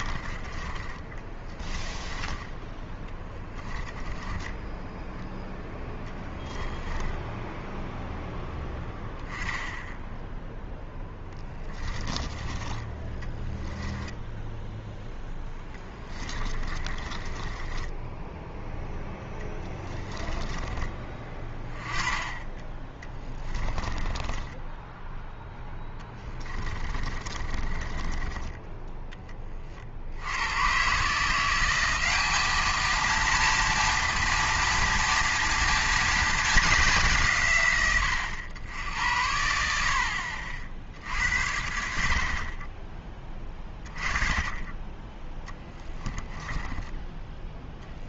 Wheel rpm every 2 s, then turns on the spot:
20, 10, 10, 10, 0, 10, 20, 0, 30, 0, 10, 20, 10, 30, 20, 120, 220, 230, 210, 90, 60, 40, 20, 20.
0-2 4-6 16-18 24-28 46-48